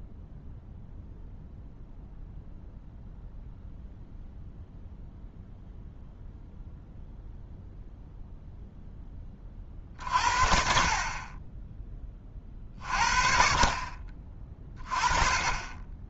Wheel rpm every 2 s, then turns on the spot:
0, 0, 0, 0, 0, 50, 50, 20.
none